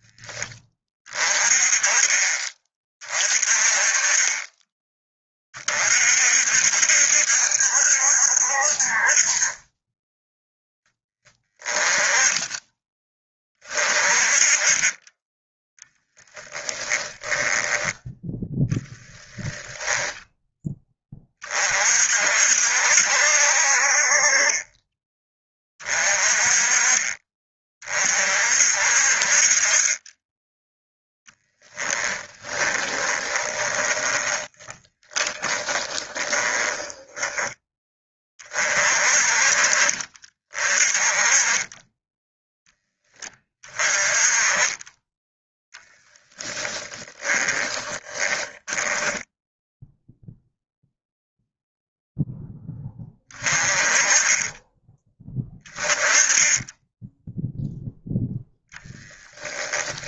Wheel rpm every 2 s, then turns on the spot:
20, 30, 20, 60, 50, 10, 20, 20, 10, 20, 20, 60, 20, 30, 50, 10, 20, 30, 10, 40, 30, 20, 20, 10, 10, 0, 20, 10, 10, 10.
16-18 32-38 46-50 58-60